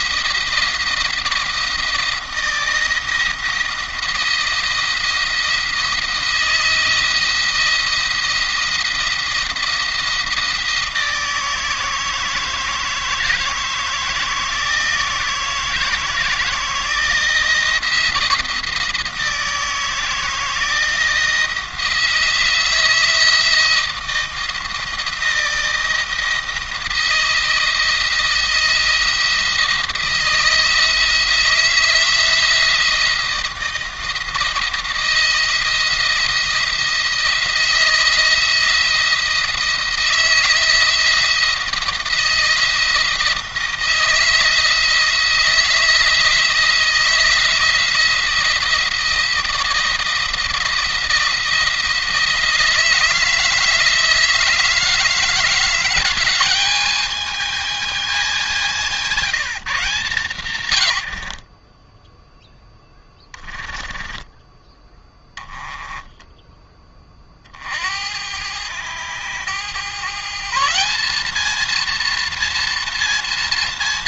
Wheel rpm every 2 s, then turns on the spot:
170, 160, 170, 170, 170, 160, 160, 160, 160, 160, 170, 170, 170, 160, 170, 160, 170, 160, 170, 170, 160, 160, 160, 170, 170, 170, 170, 160, 210, 190, 90, 10, 20, 20, 100, 180, 230.
60-66